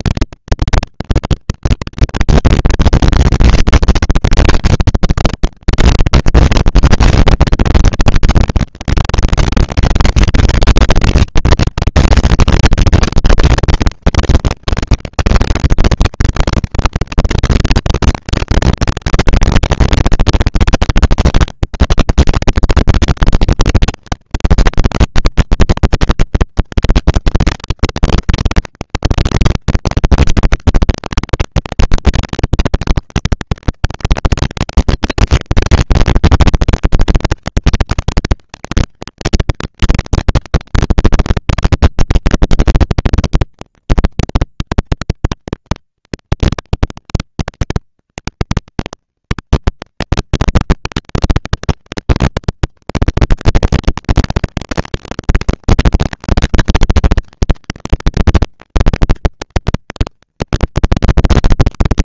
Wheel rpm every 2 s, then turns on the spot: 230, 230, 220, 220, 220, 230, 230, 230, 230, 230, 230, 210, 190, 190, 210, 220, 230, 230, 230, 220, 230, 230, 230, 230, 230, 220, 230, 230, 230, 220, 230.
none